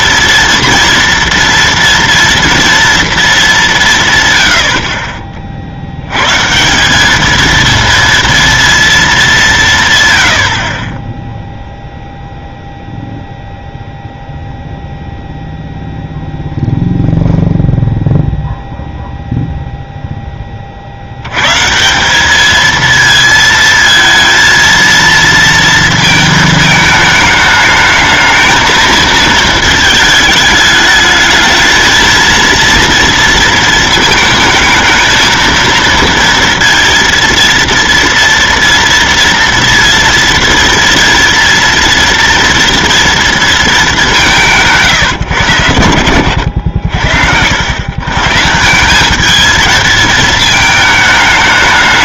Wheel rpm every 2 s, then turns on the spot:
240, 230, 90, 150, 230, 70, 0, 0, 0, 0, 20, 220, 230, 220, 220, 210, 230, 220, 230, 230, 230, 230, 160, 70, 170, 220.
none